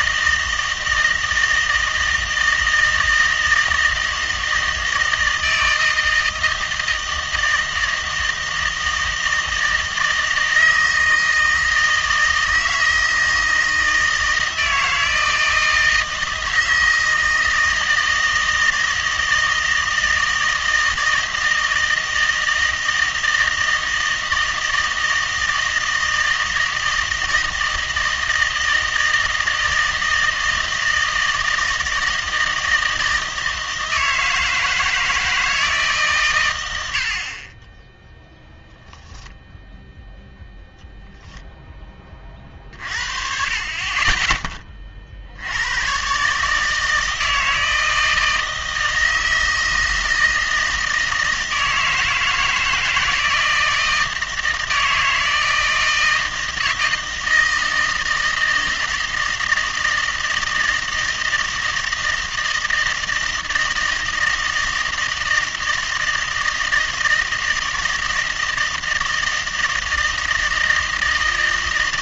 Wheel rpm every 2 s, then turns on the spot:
160, 160, 160, 160, 160, 160, 160, 160, 160, 160, 160, 160, 160, 160, 160, 160, 160, 160, 100, 0, 10, 40, 20, 150, 160, 160, 160, 160, 160, 160, 160, 160, 160, 160, 160, 160.
40-42